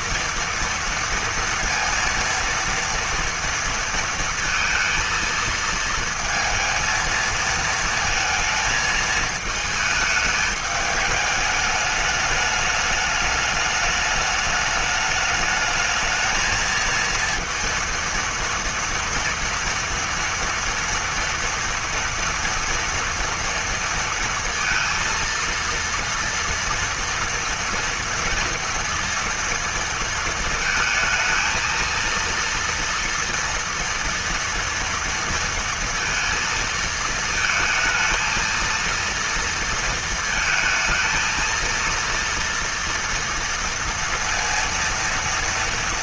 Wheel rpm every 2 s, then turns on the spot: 230, 230, 230, 220, 220, 210, 210, 210, 230, 230, 230, 230, 230, 230, 230, 220, 230, 230, 220, 230, 220, 230, 230.
none